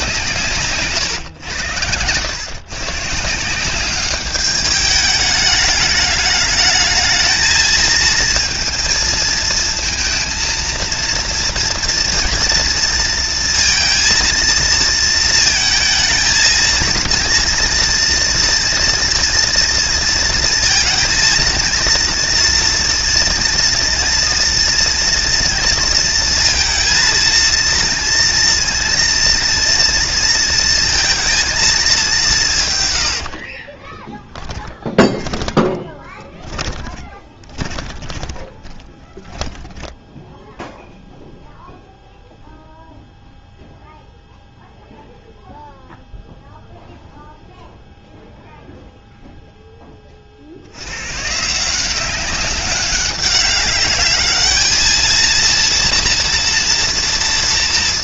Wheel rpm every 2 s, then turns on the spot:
140, 120, 210, 210, 220, 230, 230, 230, 230, 230, 220, 230, 230, 230, 230, 230, 130, 10, 20, 10, 0, 0, 0, 0, 0, 70, 200, 210, 230.
34-40